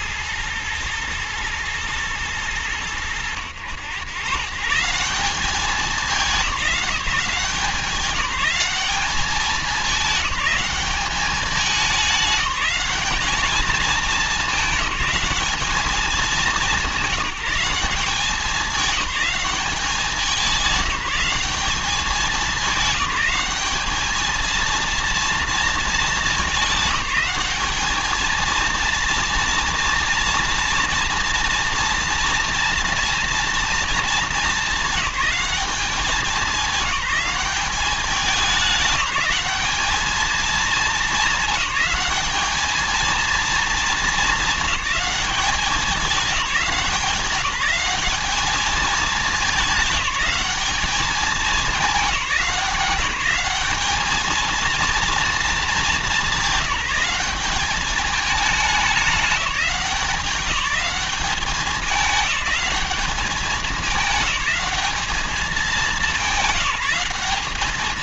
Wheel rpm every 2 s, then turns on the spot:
110, 90, 180, 190, 200, 200, 210, 210, 190, 190, 190, 190, 230, 210, 230, 230, 230, 210, 210, 200, 220, 220, 200, 190, 210, 210, 190, 220, 190, 200, 200, 210, 210, 200.
none